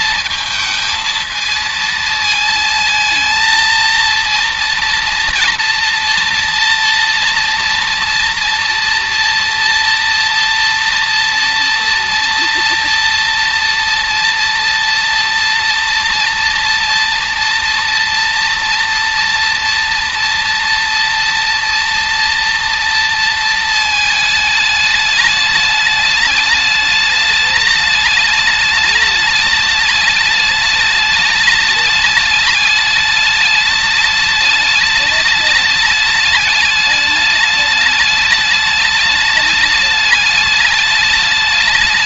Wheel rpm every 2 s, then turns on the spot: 220, 220, 230, 240, 240, 230, 240, 230, 230, 230, 230, 230, 210, 210, 210, 210, 210, 210, 210, 210, 210.
none